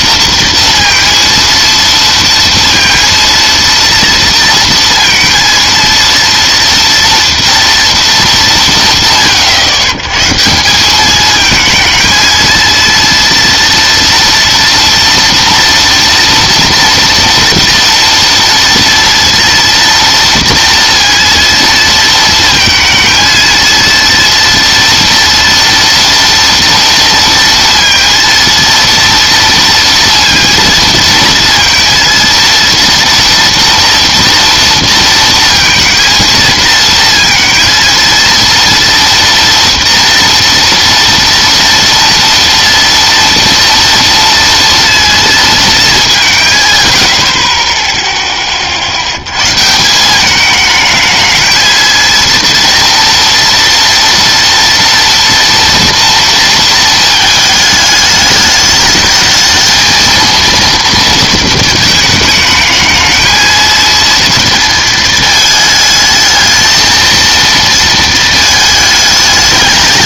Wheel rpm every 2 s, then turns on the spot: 230, 230, 230, 230, 170, 170, 230, 240, 230, 230, 230, 230, 230, 230, 230, 230, 230, 230, 230, 230, 230, 230, 230, 130, 30, 210, 230, 230, 230, 210, 230, 220, 230, 220, 220.
none